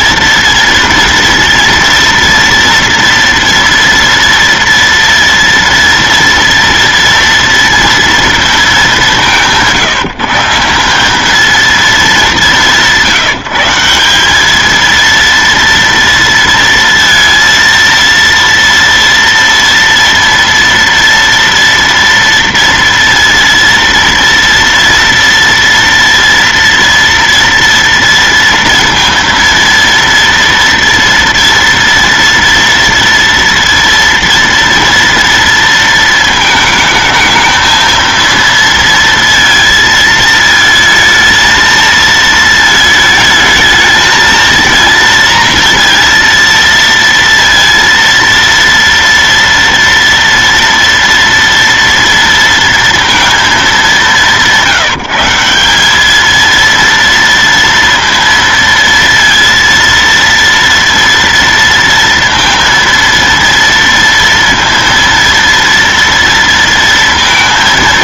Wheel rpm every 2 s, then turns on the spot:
230, 230, 240, 230, 230, 160, 200, 200, 230, 230, 230, 230, 230, 230, 230, 230, 230, 230, 220, 230, 220, 220, 220, 230, 230, 230, 230, 170, 220, 230, 230, 230, 230, 230.
none